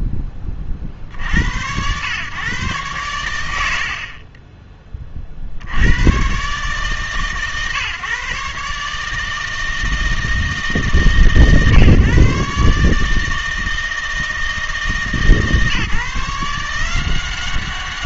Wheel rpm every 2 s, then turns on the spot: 20, 120, 30, 130, 140, 160, 150, 160, 160.
4-6